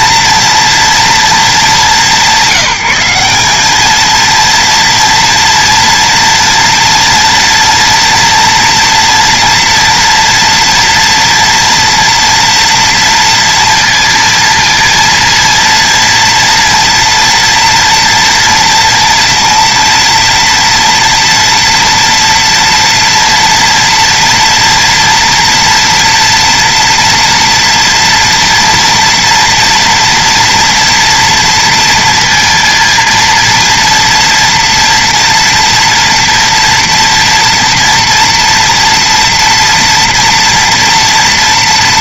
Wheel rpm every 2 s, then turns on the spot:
230, 190, 220, 230, 230, 230, 230, 230, 230, 230, 230, 230, 230, 230, 230, 240, 230, 230, 230, 230, 230.
none